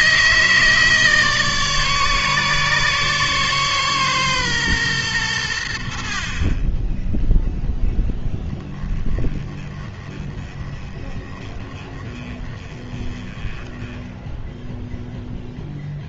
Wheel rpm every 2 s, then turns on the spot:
150, 140, 120, 20, 20, 20, 20, 0.
none